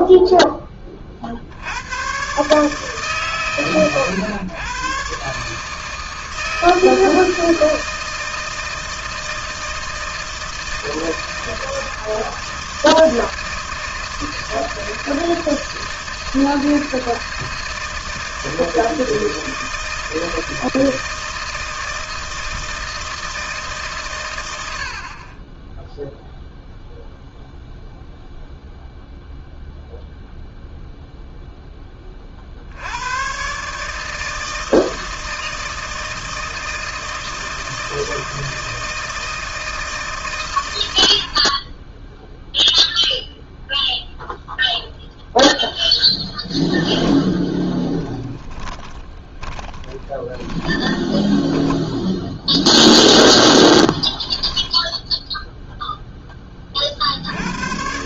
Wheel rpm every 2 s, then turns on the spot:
100, 120, 160, 160, 160, 160, 160, 160, 160, 160, 160, 150, 10, 0, 0, 0, 130, 160, 160, 160, 30, 0, 0, 30, 20, 10, 0, 0, 80.
46-52